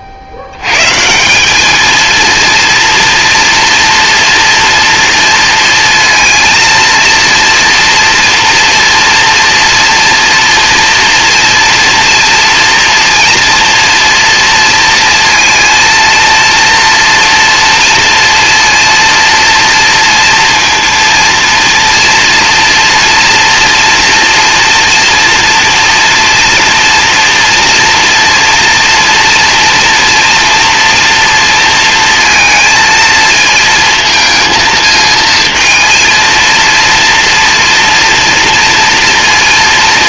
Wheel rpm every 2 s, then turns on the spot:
120, 230, 230, 230, 230, 230, 230, 230, 230, 230, 230, 240, 240, 230, 230, 230, 230, 220, 230, 230.
none